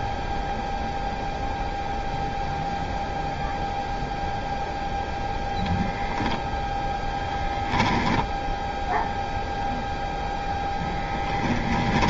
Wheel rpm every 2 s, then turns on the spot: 0, 0, 0, 0, 0, 0.
none